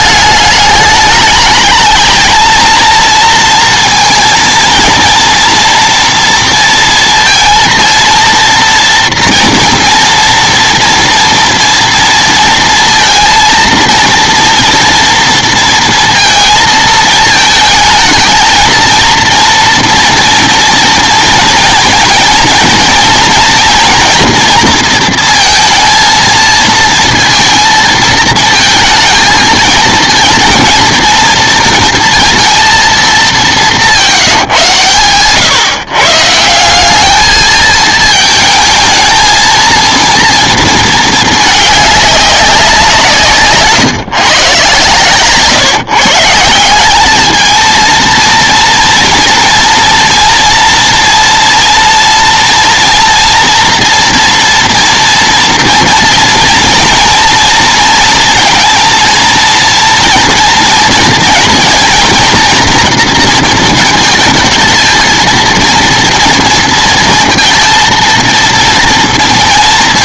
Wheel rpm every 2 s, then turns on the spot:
210, 230, 230, 230, 230, 230, 230, 230, 220, 230, 230, 220, 230, 230, 230, 230, 230, 130, 200, 220, 220, 180, 130, 200, 230, 230, 240, 230, 230, 230, 230, 230, 220, 230, 230.
none